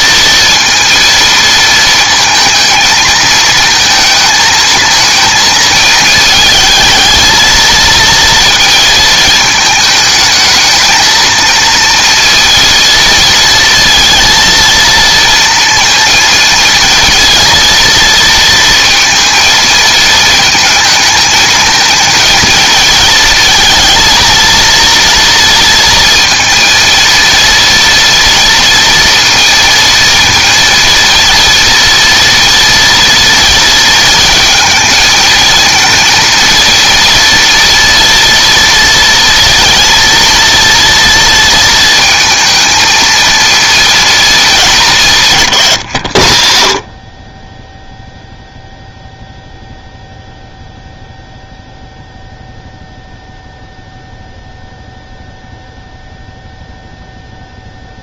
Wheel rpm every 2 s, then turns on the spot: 230, 220, 220, 220, 230, 220, 230, 230, 230, 230, 220, 220, 230, 230, 240, 230, 230, 220, 230, 240, 230, 230, 210, 50, 0, 0, 0, 0, 0.
none